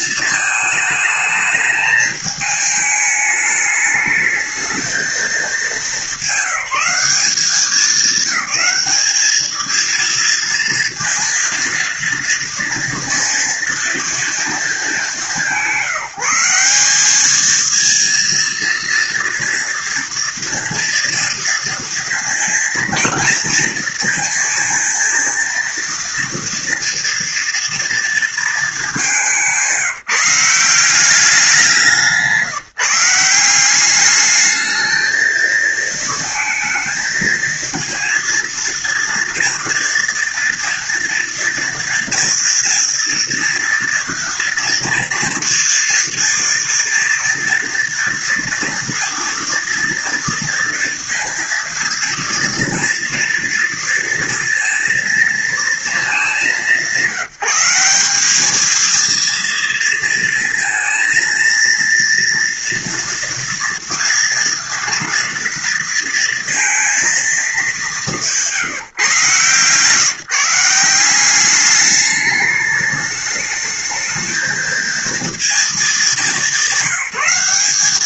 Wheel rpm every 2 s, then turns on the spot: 220, 210, 210, 190, 200, 230, 230, 220, 180, 230, 230, 230, 230, 230, 220, 170, 170, 220, 230, 230, 230, 230, 230, 230, 230, 230, 230, 230, 200, 210, 230, 230, 230, 230, 170, 160, 210, 220, 190.
none